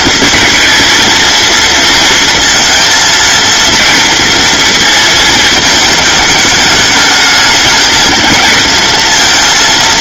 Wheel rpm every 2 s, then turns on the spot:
230, 230, 230, 210, 230.
none